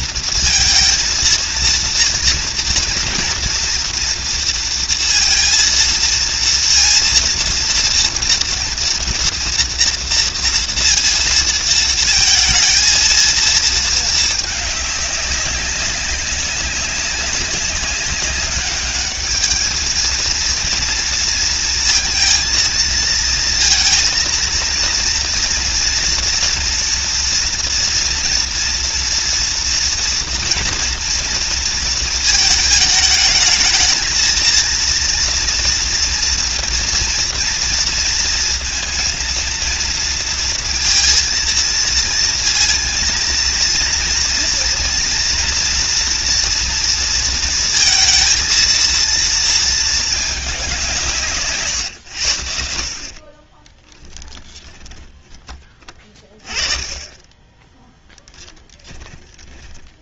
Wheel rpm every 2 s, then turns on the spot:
230, 230, 230, 230, 230, 230, 220, 220, 190, 200, 230, 220, 230, 230, 230, 240, 220, 230, 230, 230, 230, 230, 230, 230, 230, 200, 70, 10, 20, 10.
54-56 58-60